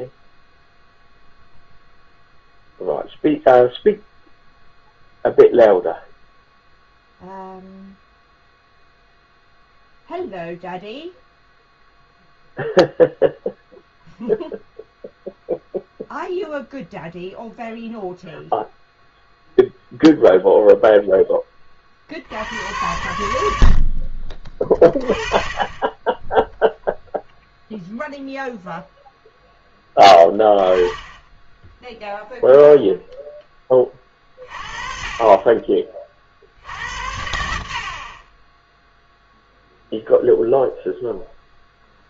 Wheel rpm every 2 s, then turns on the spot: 0, 0, 0, 0, 0, 0, 0, 0, 0, 0, 0, 80, 30, 0, 0, 10, 0, 30, 60, 10, 0.
none